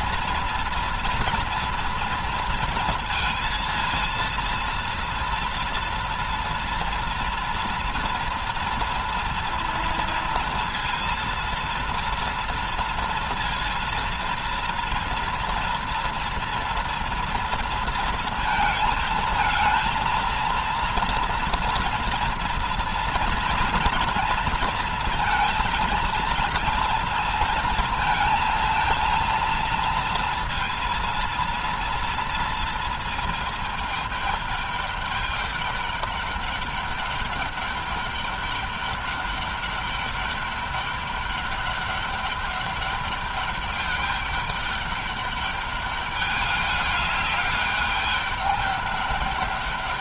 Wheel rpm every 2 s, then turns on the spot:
230, 230, 230, 240, 230, 230, 230, 230, 230, 230, 230, 230, 230, 230, 230, 230, 230, 210, 200, 200, 200, 200, 200, 200, 200.
none